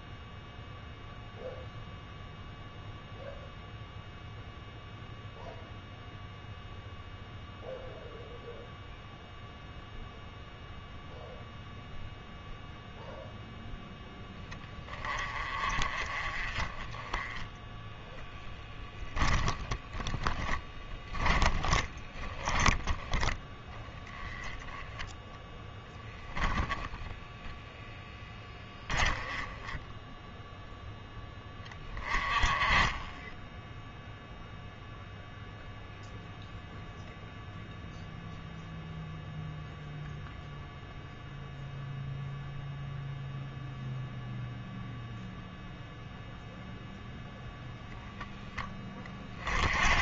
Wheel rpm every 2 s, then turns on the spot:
0, 0, 0, 0, 0, 0, 0, 20, 20, 10, 10, 20, 10, 10, 10, 0, 10, 0, 0, 0, 0, 0, 0, 0, 20.
18-22 26-30